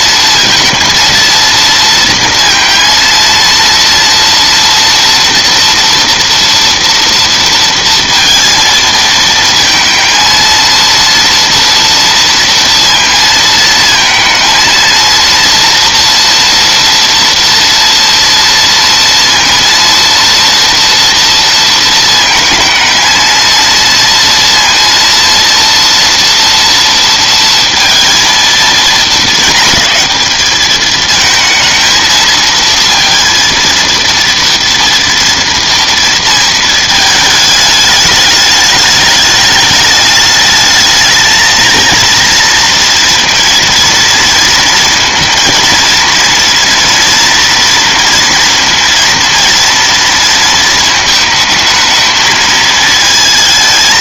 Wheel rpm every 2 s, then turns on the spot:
230, 230, 230, 230, 230, 230, 230, 230, 230, 230, 230, 230, 230, 230, 220, 220, 230, 230, 210, 210, 220, 230, 230, 230, 230, 220, 220.
none